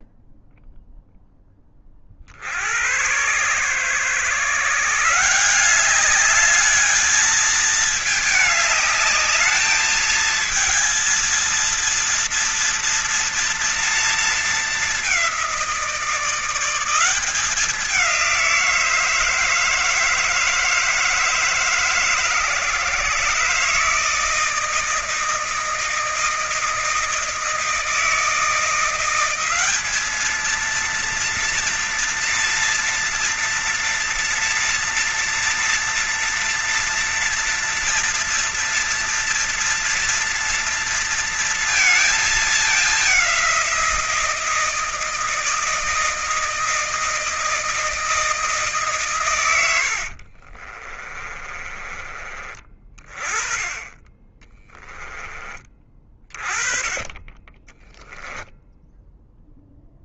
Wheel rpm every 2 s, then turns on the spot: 0, 60, 140, 210, 220, 220, 240, 220, 180, 170, 160, 150, 160, 160, 170, 220, 230, 240, 240, 230, 240, 220, 170, 160, 160, 50, 30, 40, 30, 0.
50-52 54-56